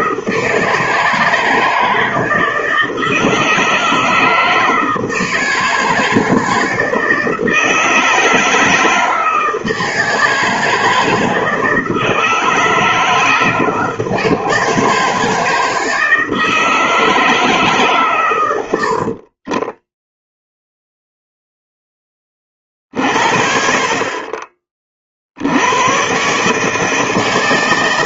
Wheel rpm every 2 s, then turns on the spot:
160, 160, 160, 160, 160, 160, 160, 160, 160, 120, 0, 30, 30, 140.
none